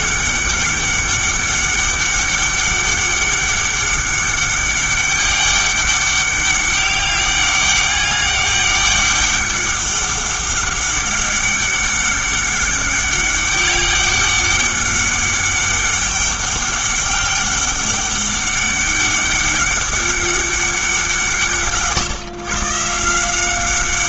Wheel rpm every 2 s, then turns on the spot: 200, 200, 200, 200, 200, 200, 200, 200, 200, 200, 190, 150.
none